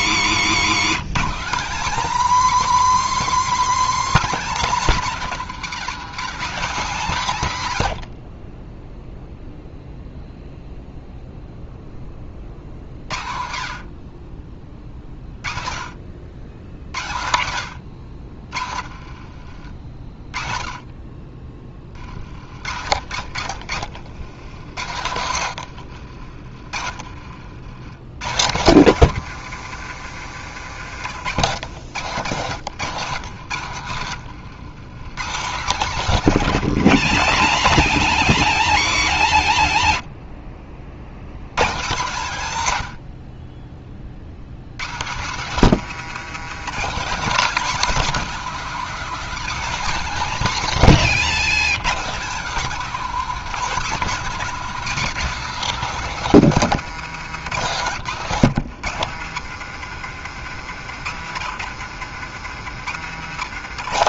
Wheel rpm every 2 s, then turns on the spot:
160, 270, 240, 200, 20, 0, 40, 30, 80, 50, 30, 60, 90, 60, 130, 120, 130, 110, 220, 230, 60, 130, 110, 210, 240, 210, 240, 250, 220, 170, 130, 140.
0-2 22-28